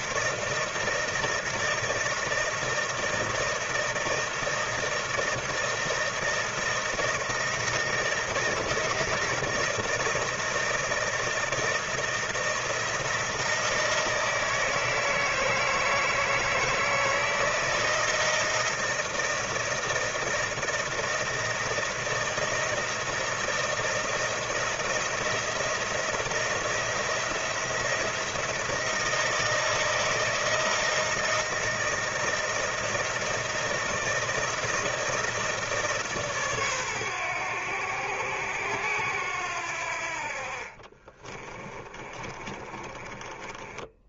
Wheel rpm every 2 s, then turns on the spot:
160, 160, 160, 160, 160, 160, 160, 160, 160, 160, 160, 160, 170, 170, 170, 160, 160, 160, 140, 90, 50, 30.
42-44